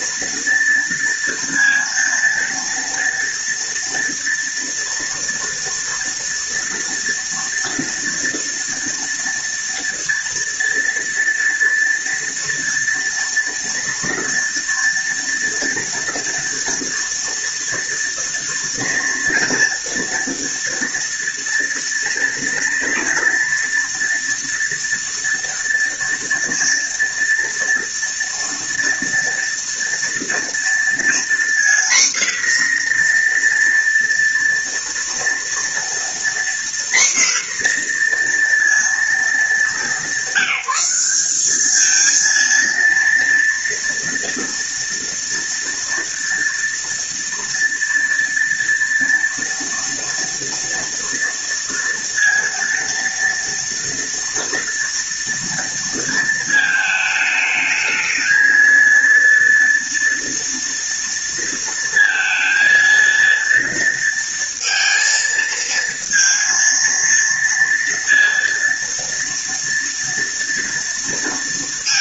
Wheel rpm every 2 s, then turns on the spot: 230, 230, 230, 230, 230, 230, 230, 240, 230, 230, 230, 230, 230, 240, 230, 240, 240, 230, 240, 220, 200, 230, 230, 230, 230, 230, 230, 230, 220, 230, 230, 230, 230, 230, 230, 230.
none